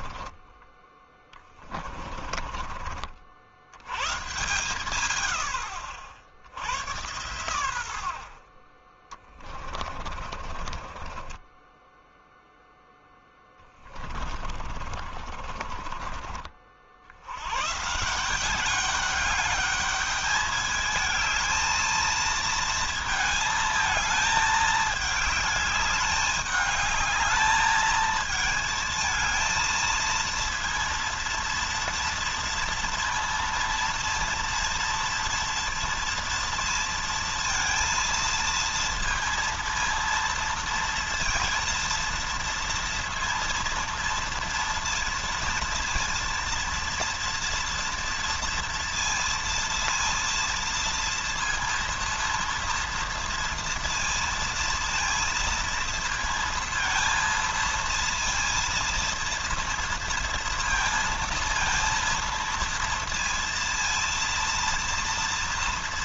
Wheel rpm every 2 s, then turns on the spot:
20, 50, 120, 100, 30, 30, 10, 40, 70, 200, 210, 230, 210, 210, 220, 230, 230, 230, 230, 230, 230, 230, 230, 230, 230, 230, 240, 230, 230, 230, 230, 230, 230.
0-2 8-12 14-16